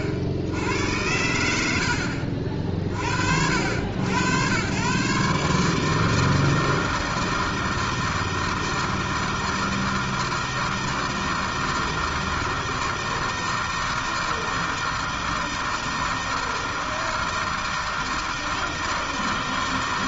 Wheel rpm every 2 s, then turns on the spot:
70, 50, 120, 160, 160, 160, 160, 160, 160, 160.
none